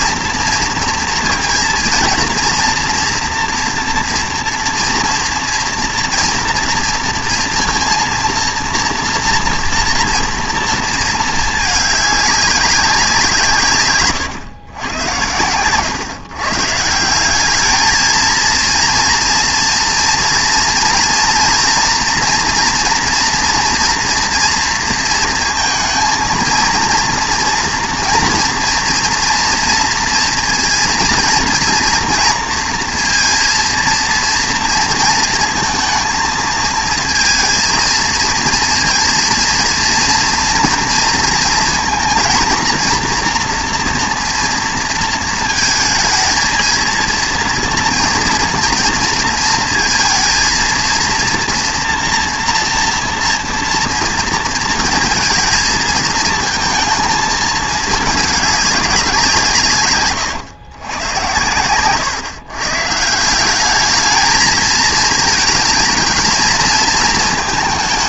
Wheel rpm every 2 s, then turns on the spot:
230, 230, 230, 230, 230, 230, 200, 120, 140, 230, 230, 230, 230, 230, 230, 240, 230, 230, 220, 230, 230, 240, 230, 230, 230, 230, 240, 230, 230, 210, 110, 130, 220, 230.
none